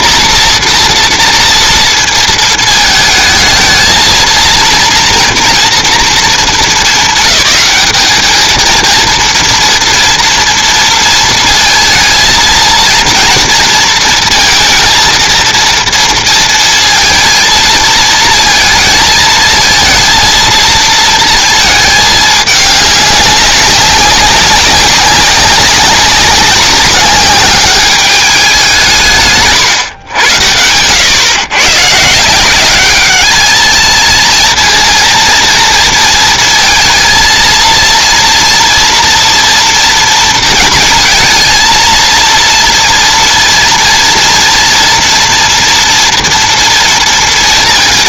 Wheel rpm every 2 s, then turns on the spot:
230, 220, 230, 200, 230, 230, 230, 230, 230, 220, 230, 200, 200, 190, 160, 120, 210, 230, 220, 230, 230, 230, 230, 230.
none